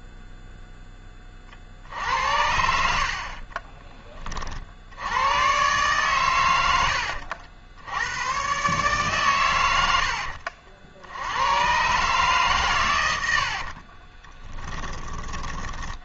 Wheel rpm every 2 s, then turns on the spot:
10, 60, 80, 80, 140, 80, 100, 20.
2-4